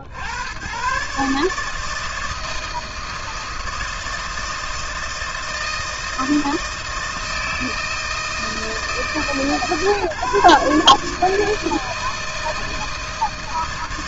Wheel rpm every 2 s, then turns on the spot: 90, 160, 160, 160, 160, 140, 160.
none